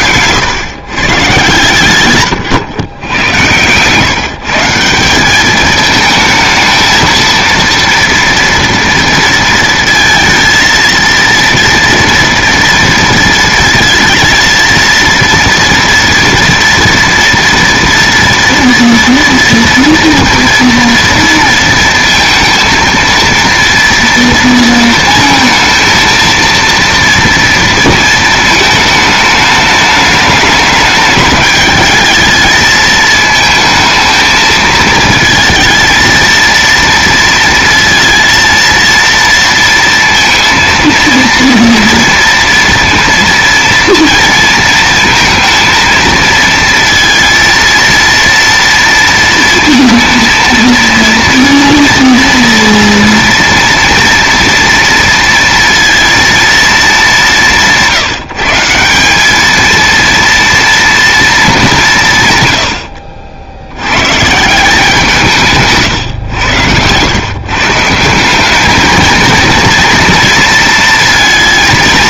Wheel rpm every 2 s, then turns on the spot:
130, 110, 170, 220, 230, 230, 230, 230, 230, 230, 230, 230, 230, 230, 220, 210, 220, 220, 230, 230, 230, 230, 230, 230, 230, 230, 230, 230, 220, 170, 230, 110, 160, 90, 210, 230.
none